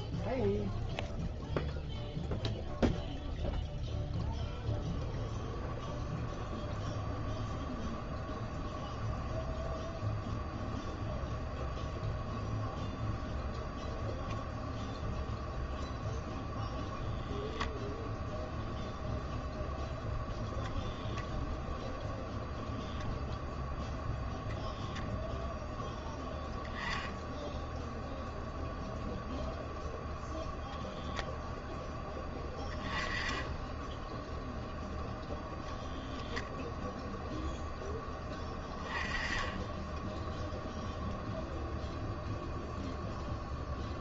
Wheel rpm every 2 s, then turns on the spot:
0, 0, 0, 0, 0, 0, 0, 0, 0, 0, 0, 0, 0, 0, 0, 0, 10, 0, 0, 10, 0, 0.
none